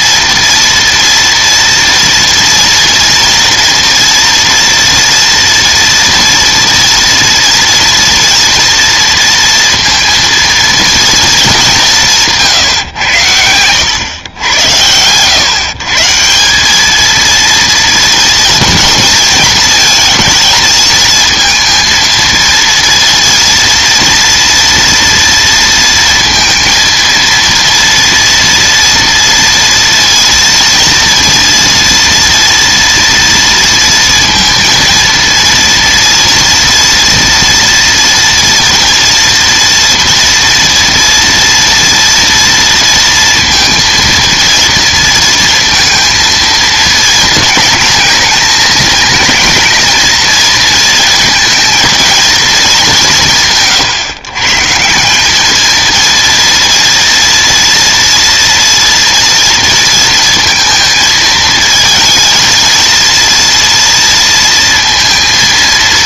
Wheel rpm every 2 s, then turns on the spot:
230, 230, 230, 240, 230, 230, 140, 100, 190, 230, 220, 230, 230, 230, 230, 230, 230, 230, 230, 230, 230, 230, 230, 220, 220, 220, 220, 150, 230, 230, 220, 230, 230.
12-14